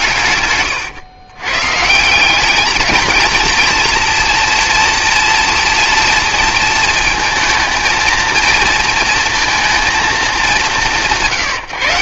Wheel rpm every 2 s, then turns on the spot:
110, 210, 230, 230, 230, 170.
none